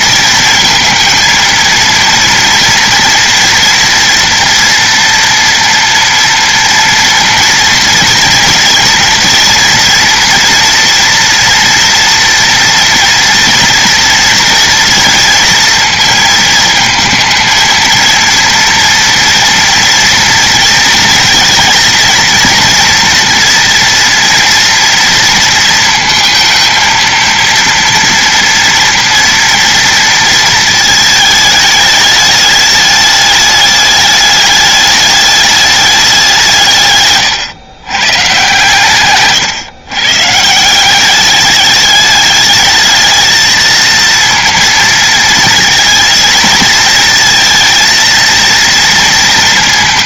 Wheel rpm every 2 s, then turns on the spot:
230, 230, 230, 230, 230, 230, 230, 230, 220, 230, 230, 240, 230, 230, 230, 220, 210, 210, 150, 140, 180, 210, 230, 220, 230.
none